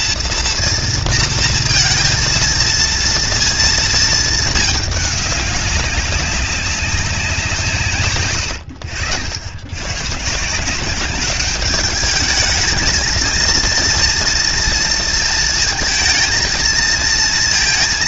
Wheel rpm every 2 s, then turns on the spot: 230, 230, 210, 190, 80, 180, 220, 230, 230.
none